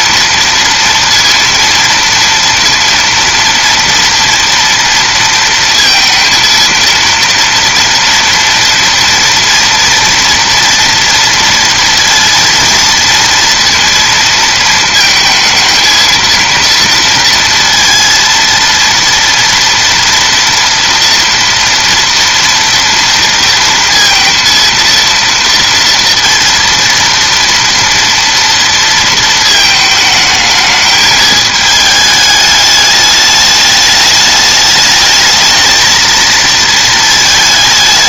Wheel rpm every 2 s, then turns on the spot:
230, 230, 230, 230, 230, 230, 230, 220, 230, 230, 230, 230, 230, 230, 230, 220, 210, 210, 230.
none